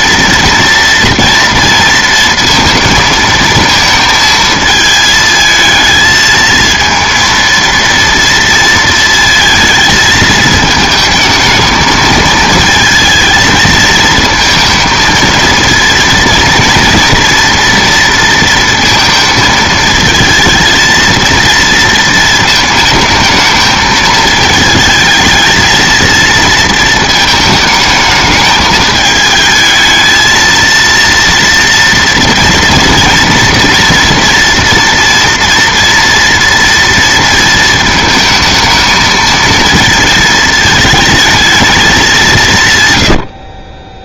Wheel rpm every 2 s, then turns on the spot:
240, 230, 220, 220, 230, 220, 220, 220, 230, 230, 230, 220, 220, 230, 220, 230, 230, 230, 230, 220, 220, 160.
none